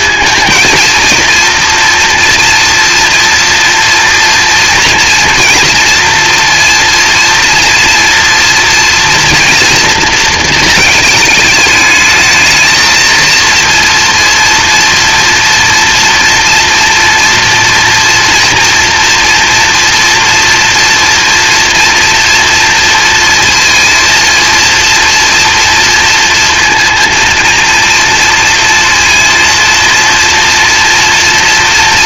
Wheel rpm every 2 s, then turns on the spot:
230, 230, 230, 230, 230, 220, 220, 230, 230, 230, 230, 230, 230, 230, 230, 230.
none